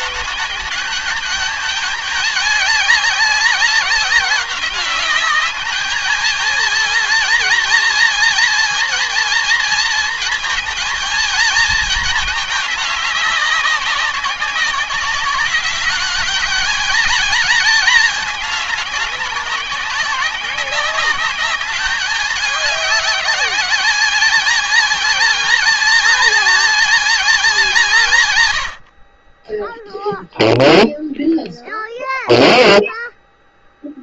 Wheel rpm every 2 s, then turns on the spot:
210, 210, 200, 220, 230, 220, 210, 190, 210, 210, 190, 200, 210, 230, 130, 0, 0.
none